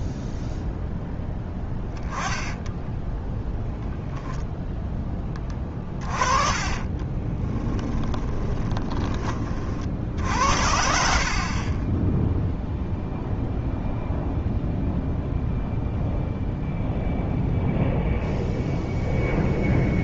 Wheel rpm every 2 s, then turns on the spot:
10, 10, 0, 30, 20, 70, 0, 0, 0, 0.
2-4 6-10